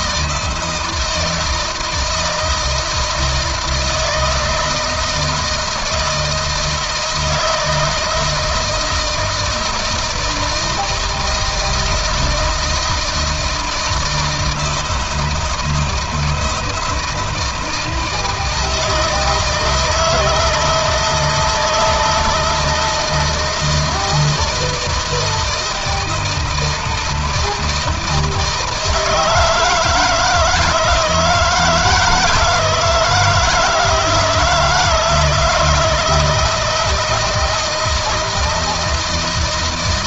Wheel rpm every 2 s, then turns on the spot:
160, 160, 160, 160, 160, 160, 160, 160, 160, 160, 170, 160, 160, 160, 160, 160, 160, 160, 170, 160.
none